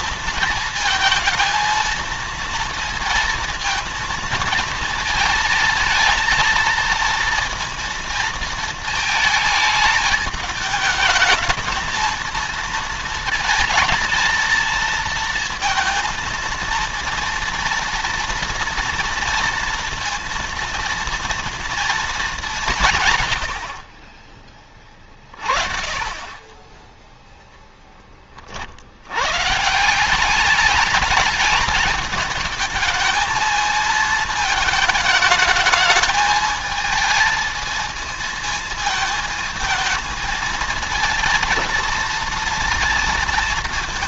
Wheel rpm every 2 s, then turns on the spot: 220, 230, 230, 230, 220, 210, 230, 230, 230, 230, 230, 170, 20, 20, 50, 210, 220, 220, 220, 220, 220, 230.
none